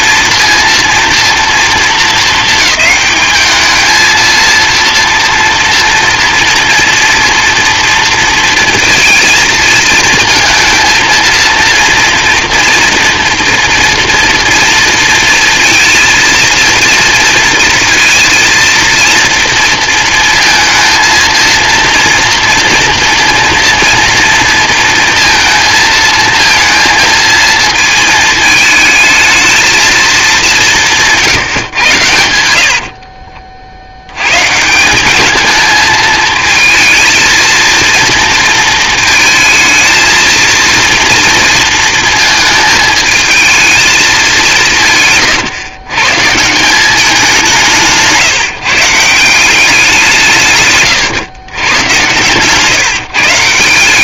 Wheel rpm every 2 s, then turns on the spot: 230, 220, 220, 230, 230, 230, 230, 230, 230, 230, 230, 230, 230, 220, 220, 210, 80, 100, 220, 230, 230, 230, 210, 140, 150, 170, 120.
none